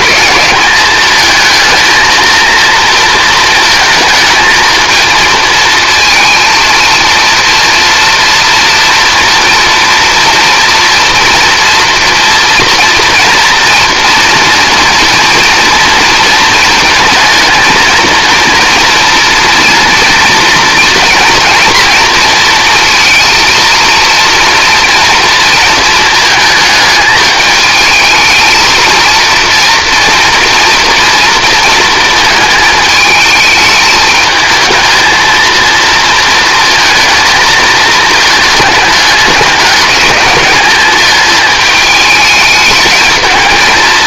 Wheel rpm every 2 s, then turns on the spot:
210, 230, 220, 230, 240, 230, 240, 240, 220, 230, 230, 230, 230, 220, 220, 240, 220, 220, 230, 210, 220, 210.
none